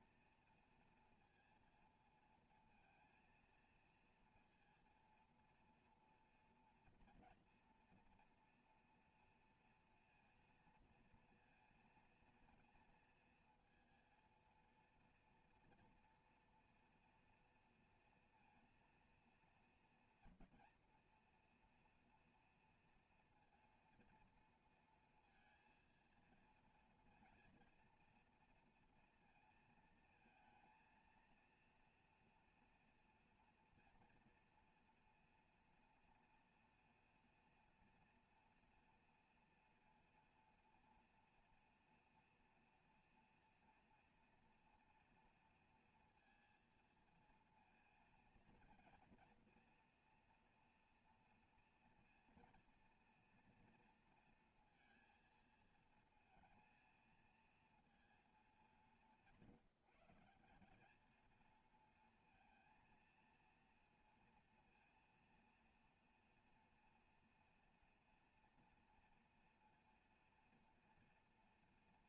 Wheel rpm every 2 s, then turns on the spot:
230, 230, 230, 230, 230, 230, 230, 230, 240, 240, 230, 240, 230, 230, 230, 230, 240, 230, 240, 230, 230, 230, 230, 230, 230, 230, 230, 230, 230, 210, 190, 220, 230, 230, 230, 240.
none